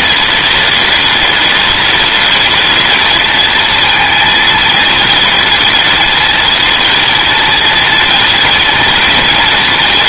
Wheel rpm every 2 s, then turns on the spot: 210, 220, 220, 220, 220.
none